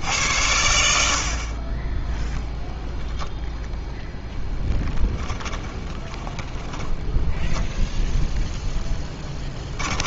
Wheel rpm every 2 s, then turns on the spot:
80, 0, 10, 10, 10.
6-8